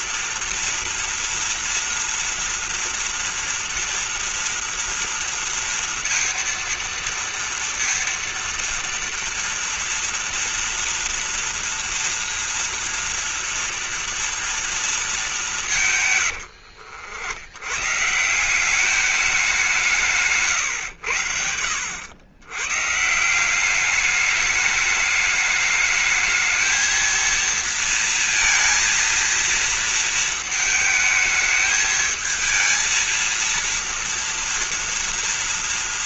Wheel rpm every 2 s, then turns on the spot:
230, 230, 230, 230, 230, 230, 240, 230, 110, 170, 140, 120, 210, 220, 230, 220, 220, 230.
16-18